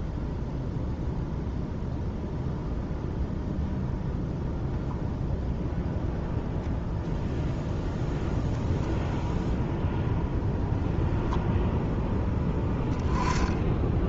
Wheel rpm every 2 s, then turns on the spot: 0, 0, 0, 0, 0, 10, 10.
none